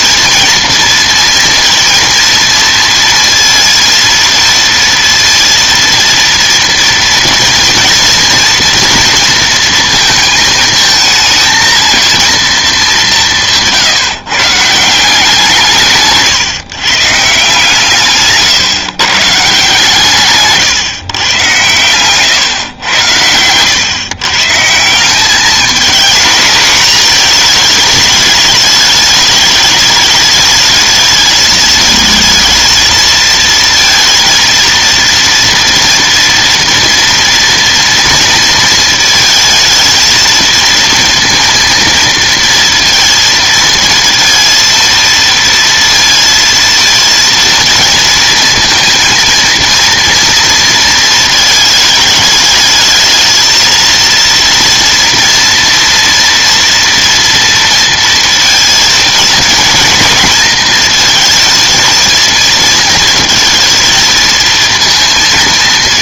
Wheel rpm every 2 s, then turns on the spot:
230, 230, 230, 230, 230, 220, 210, 160, 130, 140, 140, 120, 160, 220, 210, 210, 220, 230, 230, 220, 230, 230, 230, 230, 230, 230, 210, 230, 230, 230, 220, 230, 230.
20-22